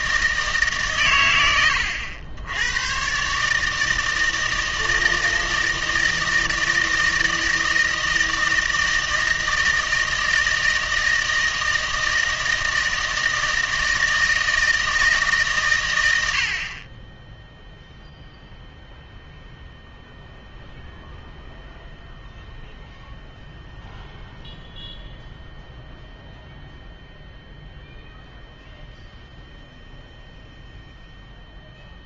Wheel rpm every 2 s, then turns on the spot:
140, 110, 160, 160, 160, 160, 160, 160, 40, 0, 0, 0, 0, 0, 0, 0.
none